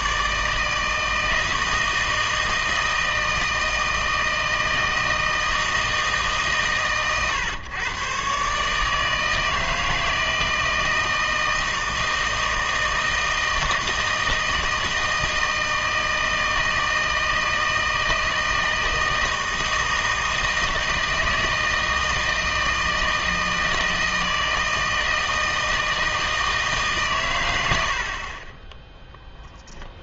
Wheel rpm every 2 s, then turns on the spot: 160, 160, 160, 130, 140, 160, 160, 160, 160, 160, 160, 160, 160, 150, 20.
none